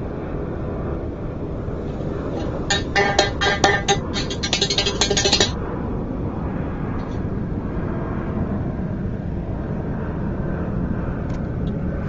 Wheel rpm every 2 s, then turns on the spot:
0, 0, 0, 0, 0, 0.
none